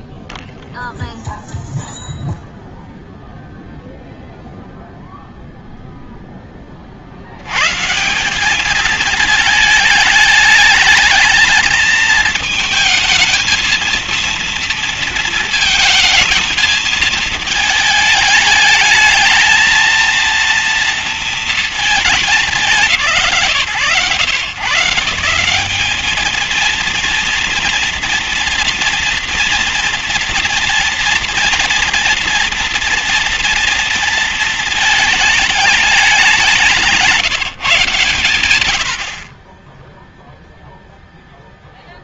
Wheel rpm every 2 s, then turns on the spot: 0, 0, 0, 120, 210, 220, 230, 220, 220, 220, 230, 130, 190, 230, 240, 230, 230, 210, 160, 20, 0.
none